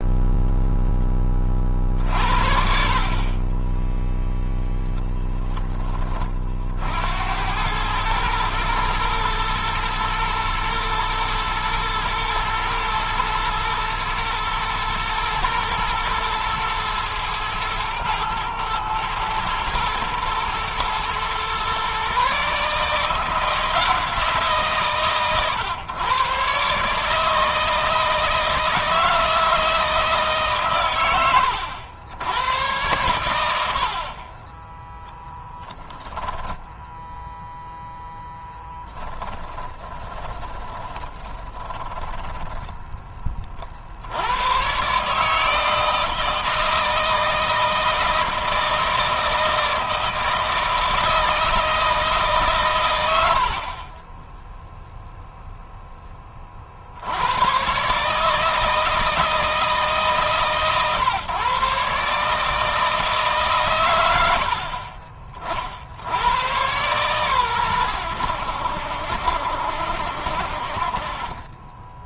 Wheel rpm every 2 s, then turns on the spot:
10, 50, 10, 60, 110, 120, 110, 120, 110, 110, 120, 160, 140, 140, 160, 130, 110, 10, 0, 10, 20, 10, 130, 160, 160, 160, 120, 0, 70, 160, 140, 160, 40, 120, 70, 40.
38-42